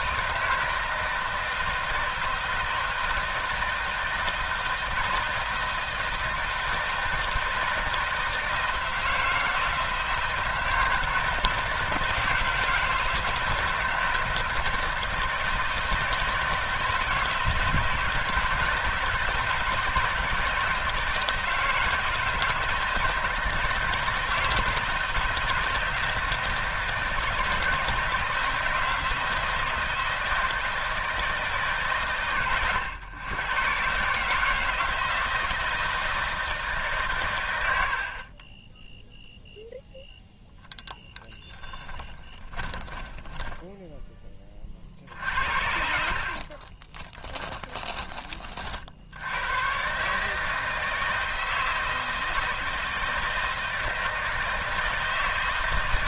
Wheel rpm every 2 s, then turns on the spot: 160, 160, 160, 160, 160, 160, 160, 160, 160, 160, 160, 160, 160, 160, 160, 160, 120, 150, 160, 60, 0, 20, 20, 50, 20, 140, 160, 160.
42-44 46-48